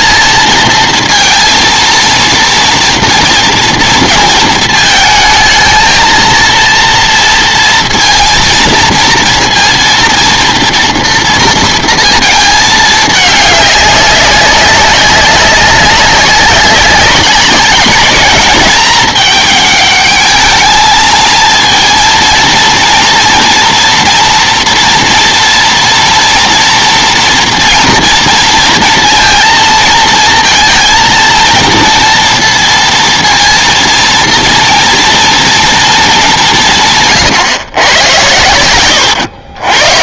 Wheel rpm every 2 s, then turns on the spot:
230, 230, 220, 230, 230, 230, 210, 200, 200, 210, 220, 230, 240, 230, 230, 230, 230, 230, 160, 100.
38-40